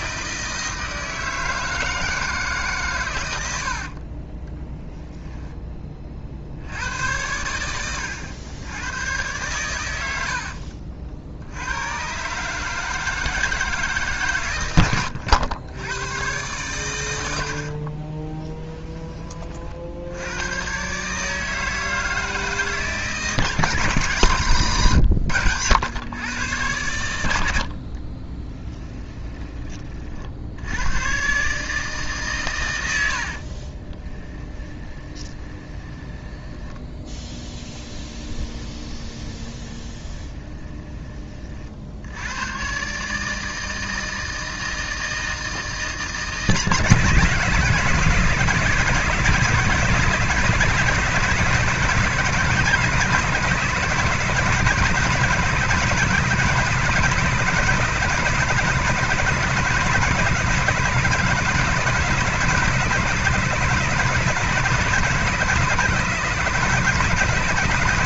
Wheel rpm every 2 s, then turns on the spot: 160, 130, 10, 80, 110, 60, 160, 120, 110, 20, 130, 150, 130, 100, 10, 100, 90, 20, 10, 20, 20, 140, 160, 150, 160, 160, 160, 160, 170, 160, 160, 170, 160, 160.
4-6 24-26 28-30 34-36 38-40